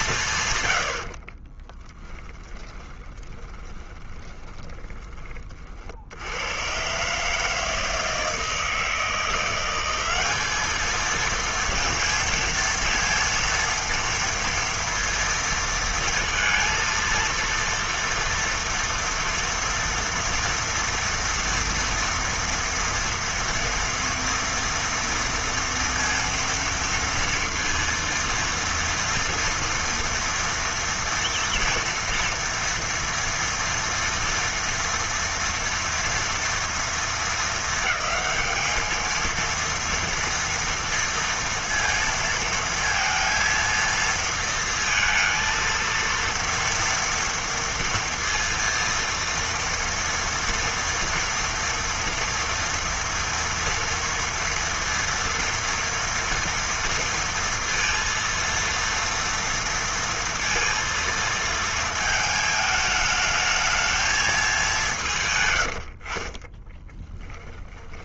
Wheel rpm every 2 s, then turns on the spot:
100, 10, 20, 110, 160, 210, 230, 230, 230, 230, 240, 230, 230, 230, 230, 230, 230, 230, 230, 220, 230, 230, 230, 230, 230, 230, 230, 230, 230, 230, 230, 210, 200, 30.
2-6 66-68